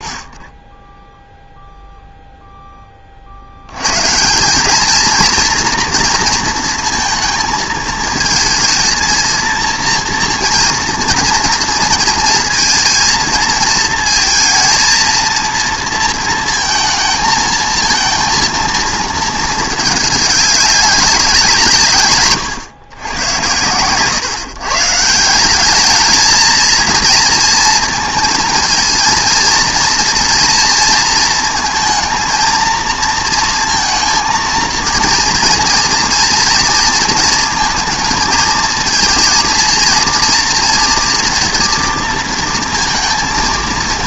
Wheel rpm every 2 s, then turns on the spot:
20, 20, 220, 230, 230, 230, 230, 230, 230, 220, 200, 110, 140, 230, 230, 230, 230, 230, 230, 230, 230, 230.
0-2